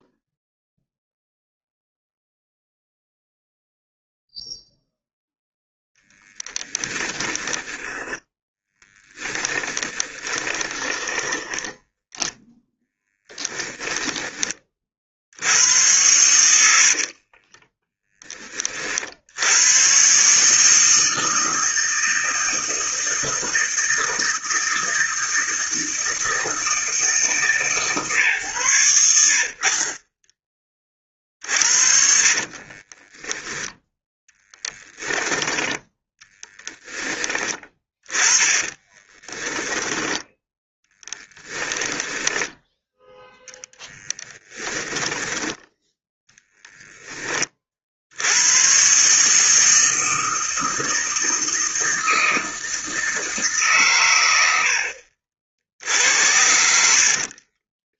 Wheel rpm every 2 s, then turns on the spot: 0, 0, 0, 10, 10, 20, 0, 30, 80, 30, 150, 160, 160, 160, 110, 20, 30, 10, 10, 20, 10, 10, 20, 10, 120, 160, 160, 80, 70.
6-12 16-18 32-36 38-40 44-48 56-58